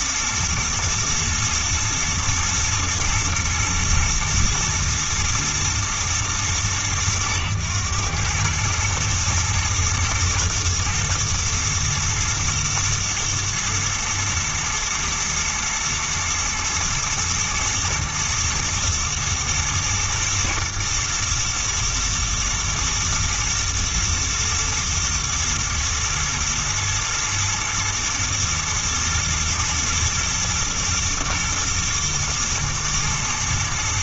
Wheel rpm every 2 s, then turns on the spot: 120, 110, 110, 110, 110, 110, 120, 120, 110, 120, 110, 110, 120, 110, 110, 110, 110.
none